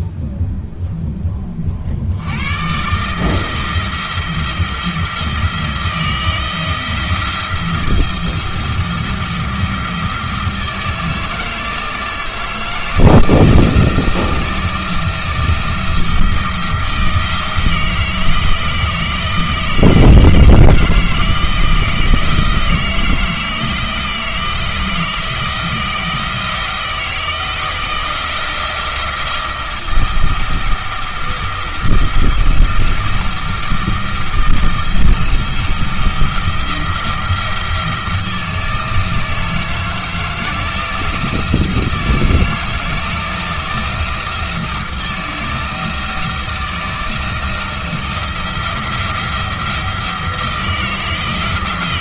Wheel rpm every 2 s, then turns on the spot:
0, 120, 170, 160, 170, 160, 160, 170, 160, 160, 160, 160, 160, 160, 170, 170, 170, 160, 170, 160, 160, 160, 170, 170, 170, 160.
none